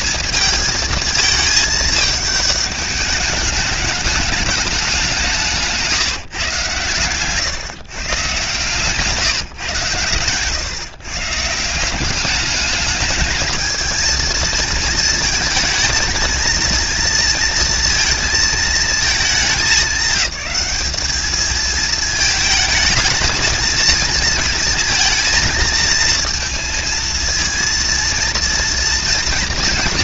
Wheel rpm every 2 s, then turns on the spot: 220, 210, 210, 130, 140, 140, 210, 220, 230, 210, 210, 220, 230, 230, 240.
8-10